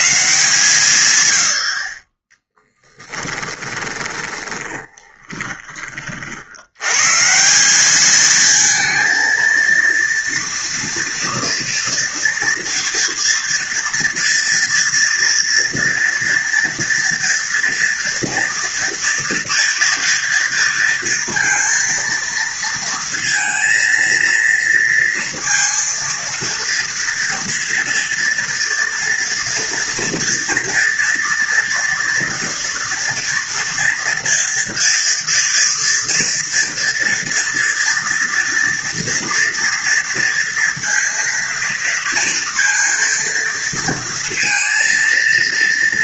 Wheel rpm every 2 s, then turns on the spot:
100, 10, 30, 110, 220, 230, 230, 230, 230, 240, 230, 230, 230, 230, 230, 230, 230, 230, 230, 240, 230, 230, 230.
4-6